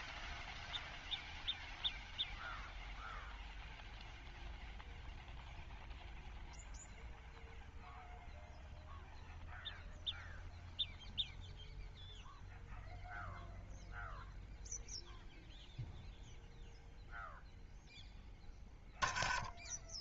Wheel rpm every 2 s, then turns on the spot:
0, 0, 0, 0, 0, 0, 0, 0, 0, 0.
none